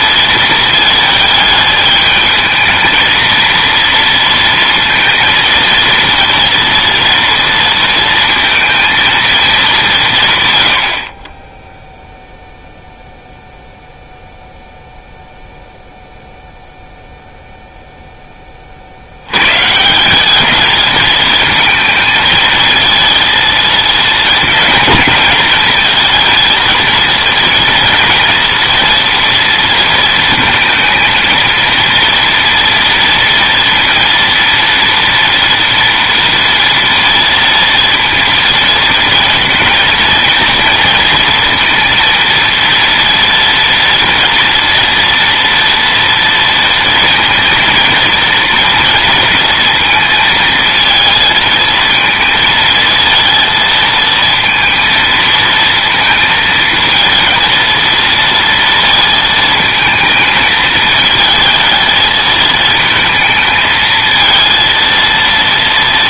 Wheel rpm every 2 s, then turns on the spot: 220, 220, 230, 230, 230, 90, 0, 0, 0, 40, 220, 230, 230, 230, 230, 230, 230, 230, 230, 230, 230, 230, 230, 230, 230, 230, 230, 230, 220, 230, 220, 220, 230.
none